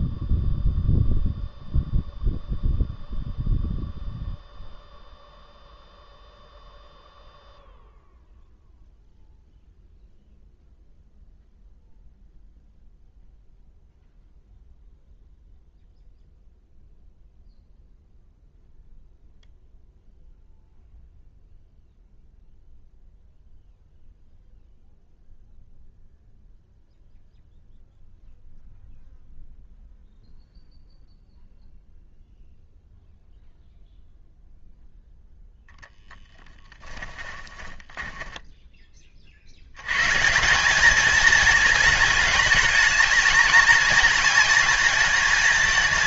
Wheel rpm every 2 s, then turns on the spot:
0, 0, 0, 0, 0, 0, 0, 0, 0, 0, 0, 0, 0, 0, 0, 0, 0, 0, 10, 10, 190, 220, 220.
36-38